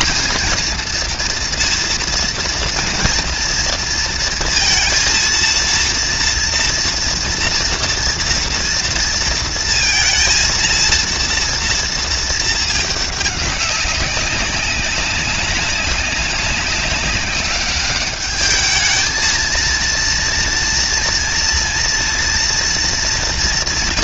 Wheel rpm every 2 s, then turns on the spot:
220, 230, 230, 230, 230, 230, 230, 200, 200, 200, 220, 230.
none